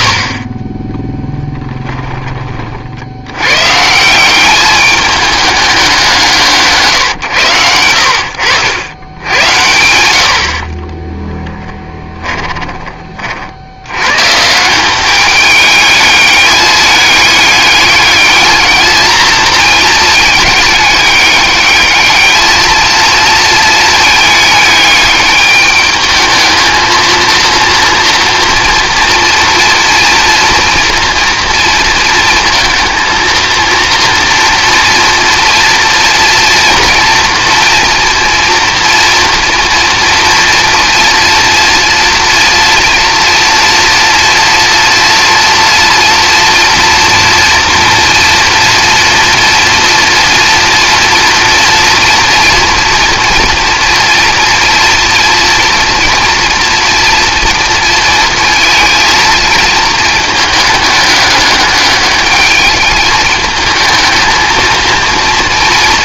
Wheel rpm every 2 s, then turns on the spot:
20, 50, 200, 150, 100, 30, 20, 180, 210, 220, 210, 230, 210, 230, 230, 230, 230, 230, 240, 230, 230, 230, 240, 230, 230, 230, 230, 230, 230, 220, 210, 210, 230.
10-12